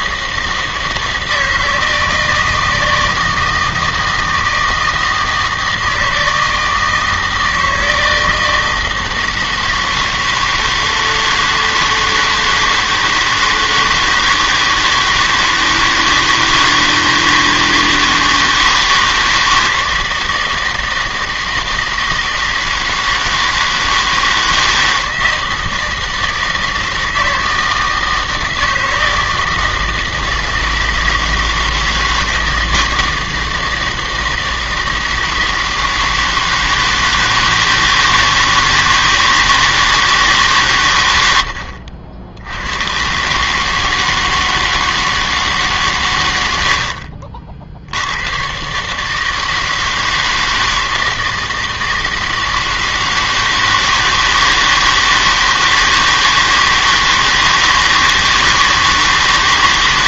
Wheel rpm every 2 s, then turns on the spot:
160, 160, 160, 160, 160, 160, 160, 160, 160, 160, 160, 160, 160, 160, 160, 160, 160, 160, 160, 160, 140, 90, 160, 60, 130, 160, 160, 160, 160, 160.
46-48